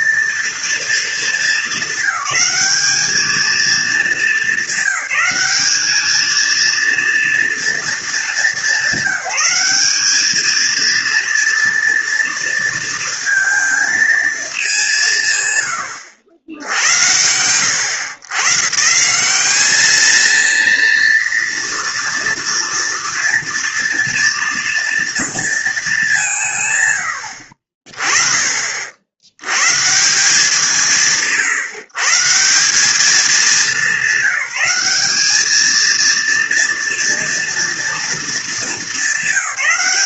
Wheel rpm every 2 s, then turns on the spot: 230, 220, 200, 230, 200, 230, 230, 180, 80, 150, 230, 230, 230, 100, 40, 160, 200, 200, 230, 210.
none